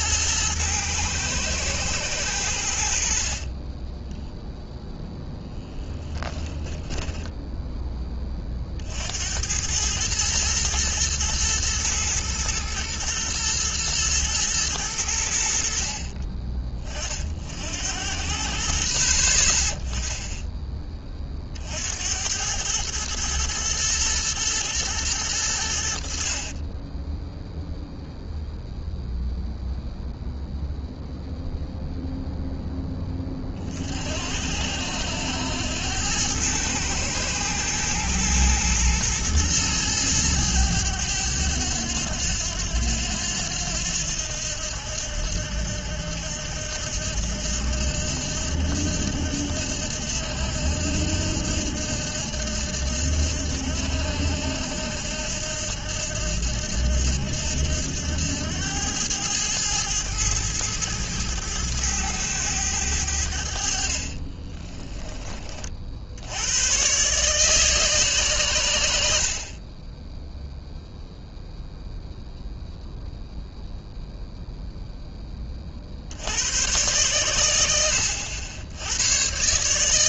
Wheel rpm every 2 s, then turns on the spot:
110, 70, 0, 10, 60, 110, 110, 100, 40, 60, 20, 110, 110, 20, 0, 0, 10, 80, 110, 110, 100, 90, 80, 80, 80, 80, 80, 80, 80, 100, 110, 90, 20, 120, 90, 0, 0, 0, 110, 100.
6-8 64-66